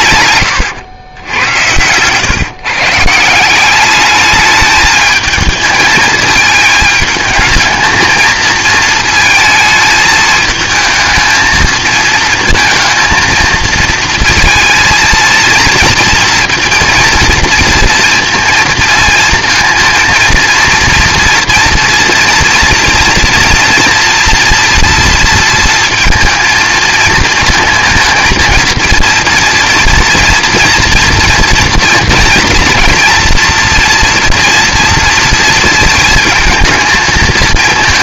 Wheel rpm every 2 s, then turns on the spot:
110, 140, 210, 220, 230, 220, 220, 230, 230, 230, 230, 230, 230, 230, 230, 230, 230, 230, 220.
0-2